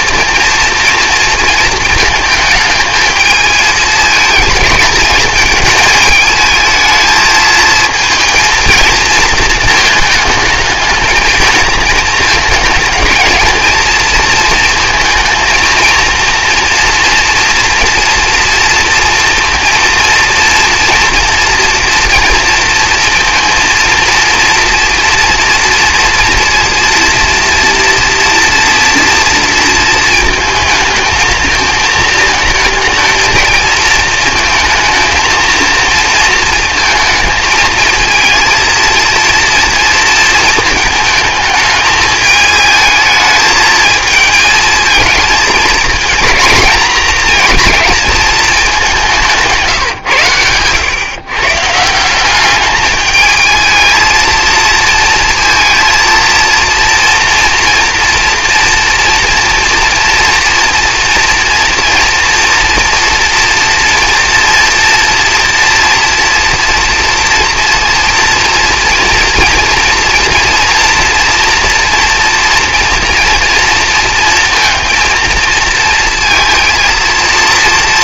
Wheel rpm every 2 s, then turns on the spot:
230, 220, 220, 220, 220, 220, 220, 220, 230, 230, 230, 230, 230, 230, 230, 220, 220, 220, 230, 230, 220, 220, 220, 220, 200, 130, 210, 220, 230, 240, 230, 230, 240, 230, 240, 240, 240, 230, 230.
none